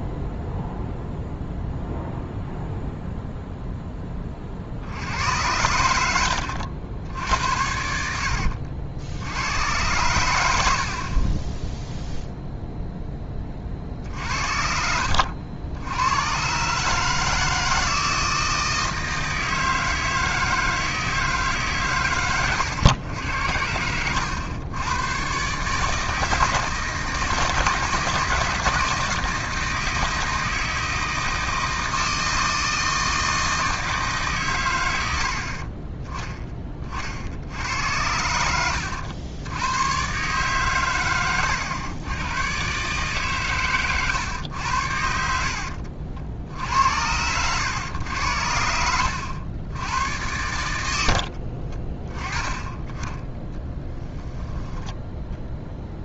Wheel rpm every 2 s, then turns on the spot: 0, 0, 50, 80, 70, 70, 0, 70, 130, 160, 160, 110, 100, 160, 160, 160, 160, 120, 20, 80, 130, 130, 100, 70, 80, 100, 10, 10.
none